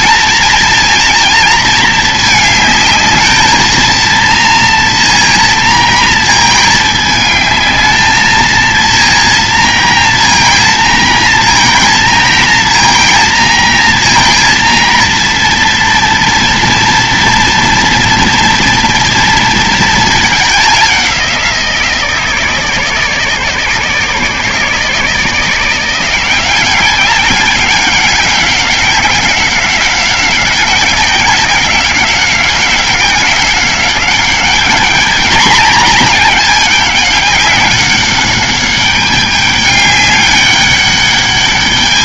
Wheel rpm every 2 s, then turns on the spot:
230, 220, 230, 220, 220, 230, 230, 230, 230, 230, 210, 160, 160, 180, 190, 190, 190, 210, 210, 200, 200.
none